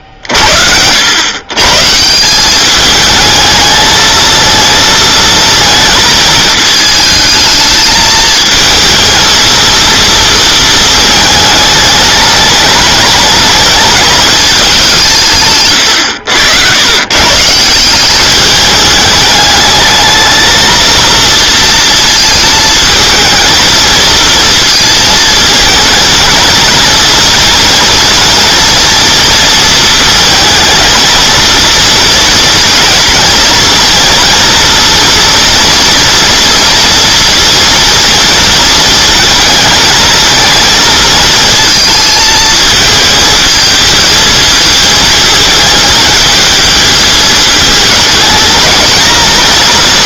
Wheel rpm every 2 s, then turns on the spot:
70, 200, 230, 220, 220, 220, 210, 210, 100, 210, 230, 220, 230, 220, 230, 220, 230, 230, 230, 220, 230, 220, 220, 220, 220.
none